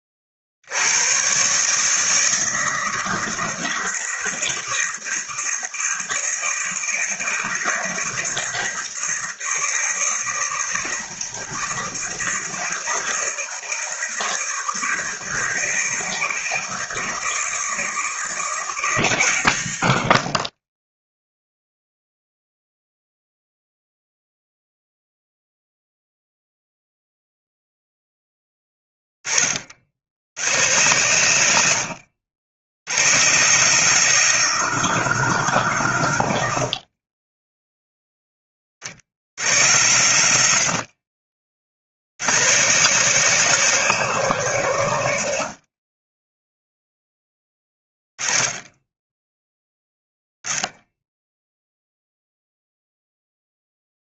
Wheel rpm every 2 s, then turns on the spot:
50, 160, 160, 160, 160, 160, 160, 160, 160, 160, 20, 0, 0, 0, 10, 120, 100, 190, 60, 70, 60, 150, 140, 0, 10, 10, 0.
none